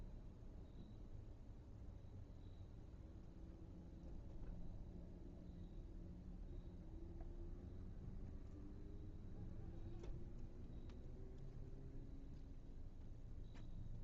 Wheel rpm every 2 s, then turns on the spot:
0, 0, 0, 0, 0, 0, 0.
none